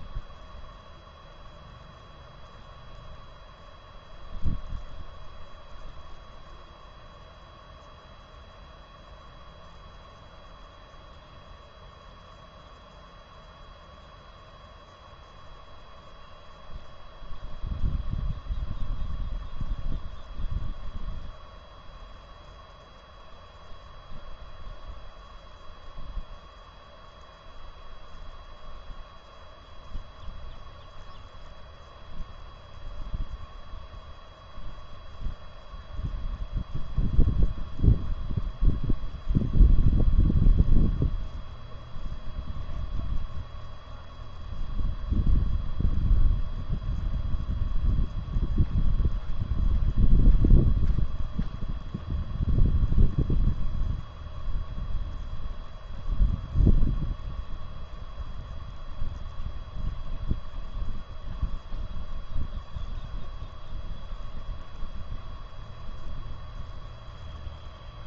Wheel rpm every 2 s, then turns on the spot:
0, 0, 0, 0, 0, 0, 0, 0, 0, 0, 0, 0, 0, 0, 0, 0, 0, 0, 0, 0, 0, 0, 0, 0, 0, 0, 0, 0, 0, 0, 0, 0, 0, 0.
none